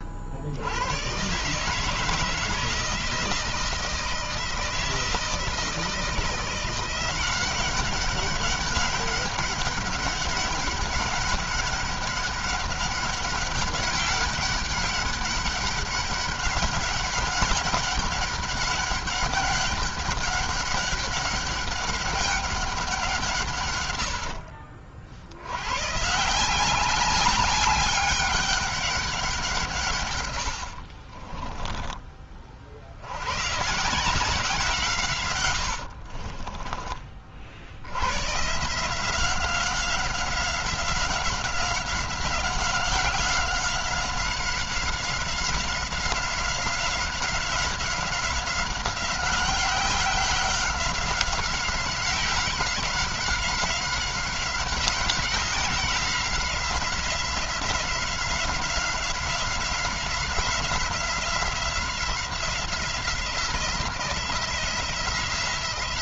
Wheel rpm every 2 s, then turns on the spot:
90, 160, 160, 180, 200, 200, 200, 200, 190, 190, 200, 180, 60, 190, 190, 40, 70, 150, 30, 160, 190, 180, 190, 190, 190, 190, 190, 190, 180, 180, 180, 180, 170.
30-32